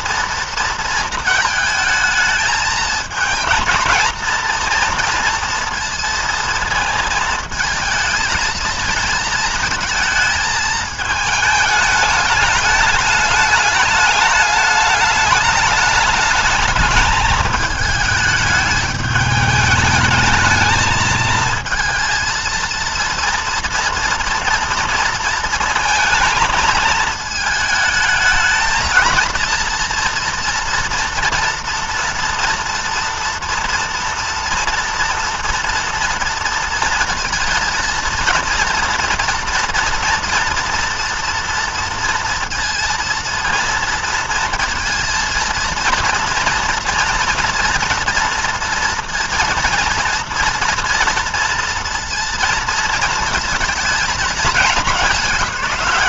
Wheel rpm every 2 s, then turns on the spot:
230, 220, 230, 230, 220, 220, 210, 210, 210, 210, 220, 230, 230, 220, 220, 240, 240, 240, 230, 230, 230, 230, 230, 230, 230, 240, 230, 220.
none